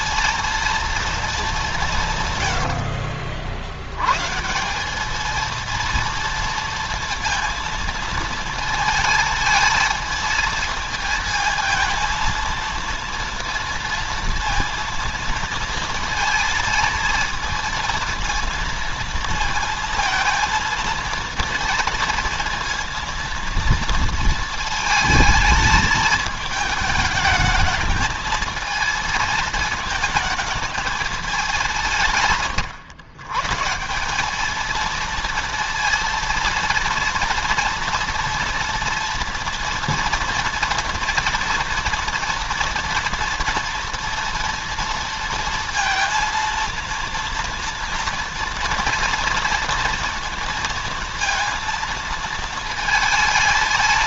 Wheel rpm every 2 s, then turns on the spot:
230, 110, 170, 230, 230, 220, 230, 230, 230, 230, 230, 230, 220, 220, 220, 220, 140, 220, 230, 230, 230, 230, 230, 230, 240, 230, 220.
2-4